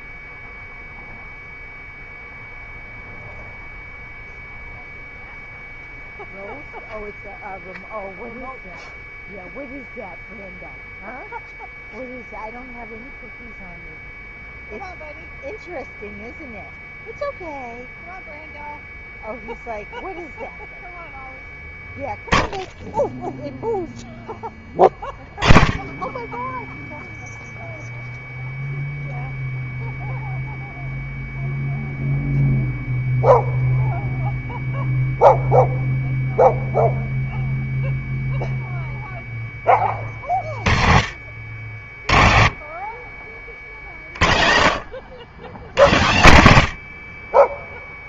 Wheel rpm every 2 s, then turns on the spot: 0, 0, 0, 0, 0, 0, 0, 0, 0, 0, 0, 10, 20, 10, 0, 0, 0, 0, 0, 0, 50, 40, 70, 80.
none